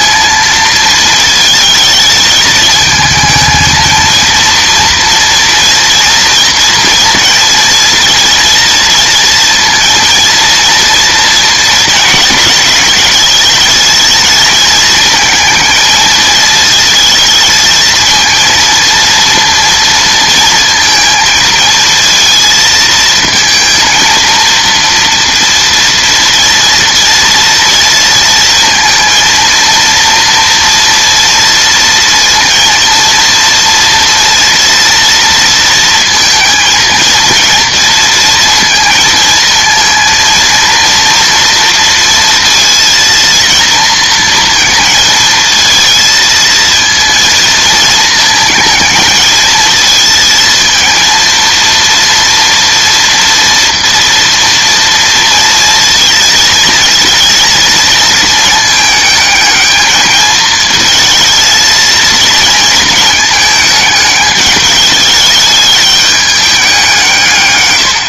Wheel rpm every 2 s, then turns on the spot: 220, 220, 230, 230, 230, 230, 220, 220, 220, 230, 230, 230, 230, 230, 230, 230, 230, 230, 230, 220, 230, 230, 230, 230, 220, 230, 230, 230, 230, 220, 220, 220, 210, 180.
none